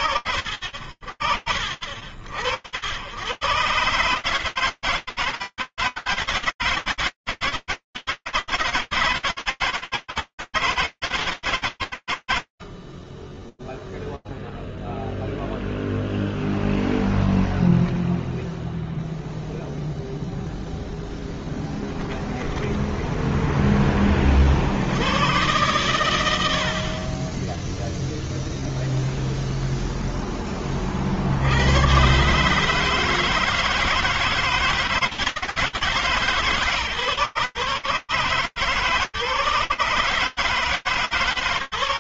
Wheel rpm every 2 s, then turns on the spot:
60, 90, 160, 160, 160, 150, 20, 0, 0, 0, 0, 10, 70, 50, 0, 60, 160, 160, 140, 150, 140.
22-24